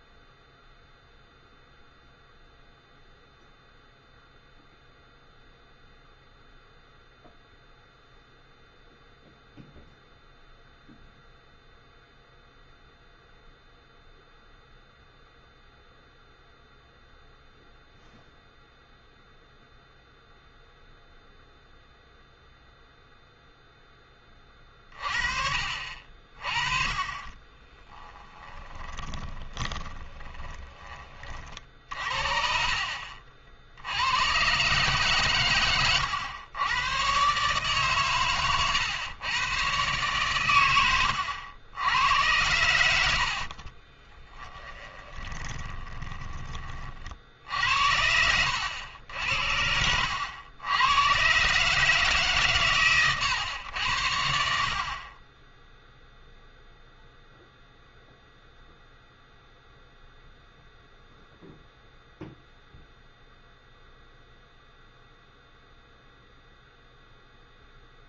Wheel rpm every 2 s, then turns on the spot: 0, 0, 0, 0, 0, 0, 0, 0, 0, 0, 0, 0, 30, 30, 20, 20, 50, 130, 100, 120, 110, 90, 20, 30, 90, 100, 140, 60, 0, 0, 0, 0, 0, 0.
28-32 40-42 44-46